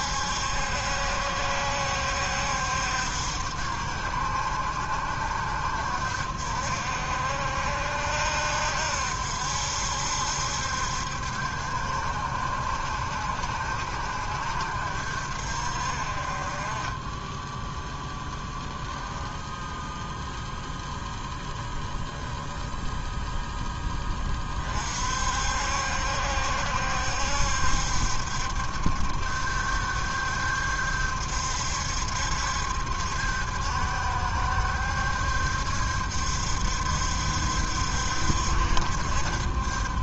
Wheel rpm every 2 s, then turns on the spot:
70, 60, 60, 60, 70, 70, 60, 60, 20, 10, 0, 0, 50, 70, 70, 70, 70, 70, 70, 70.
none